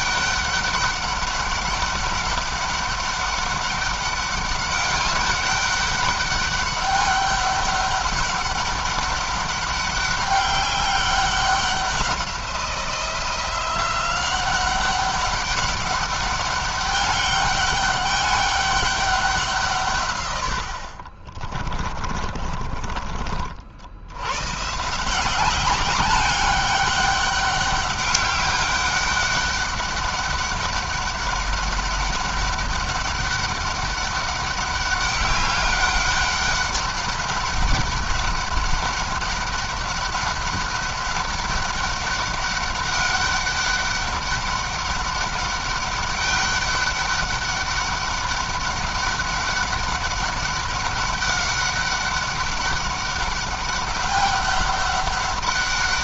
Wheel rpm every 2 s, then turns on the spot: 200, 200, 200, 200, 200, 190, 180, 190, 200, 200, 60, 40, 150, 200, 200, 200, 200, 200, 200, 200, 200, 200, 200, 200, 200, 200, 200, 200.
20-22